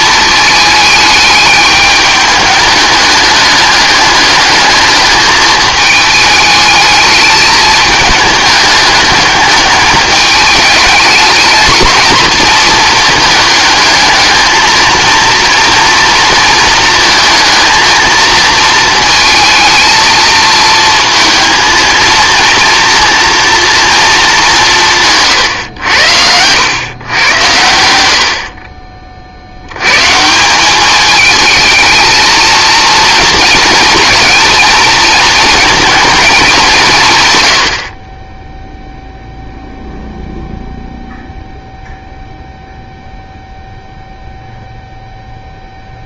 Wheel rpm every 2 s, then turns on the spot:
220, 210, 210, 210, 210, 210, 220, 220, 220, 220, 220, 230, 200, 100, 40, 180, 230, 230, 190, 0, 0, 0, 0.
none